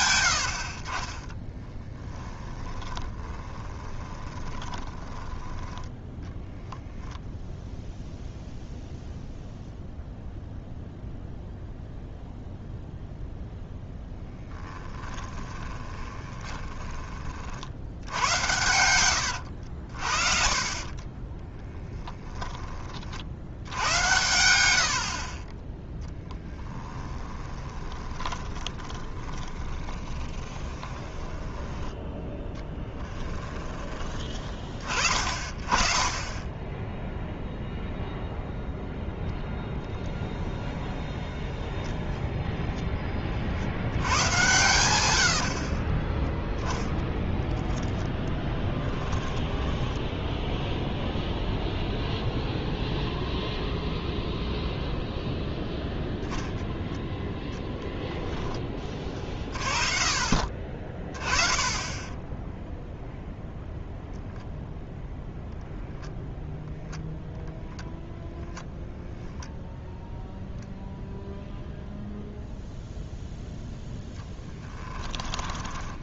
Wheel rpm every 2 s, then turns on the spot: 50, 10, 20, 20, 0, 0, 0, 10, 20, 100, 30, 30, 70, 10, 20, 20, 10, 20, 10, 0, 0, 10, 100, 10, 10, 0, 0, 0, 0, 30, 30, 0, 0, 0, 10, 0, 0, 10.
2-6 14-22 26-34 44-46 48-50 68-70 74-76